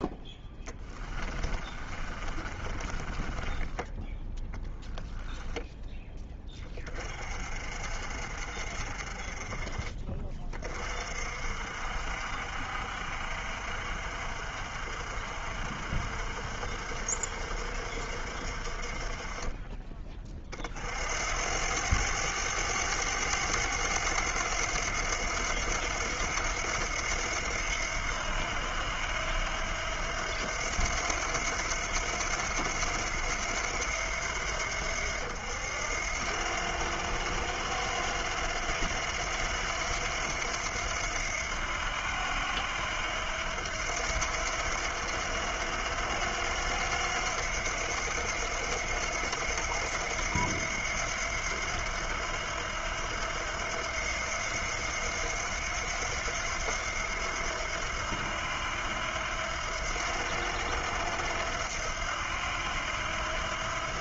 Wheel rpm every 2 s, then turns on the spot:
10, 30, 10, 20, 50, 40, 60, 60, 60, 50, 40, 100, 90, 80, 80, 80, 80, 80, 80, 90, 80, 80, 80, 90, 80, 90, 90, 80, 90, 80, 80, 80.
0-4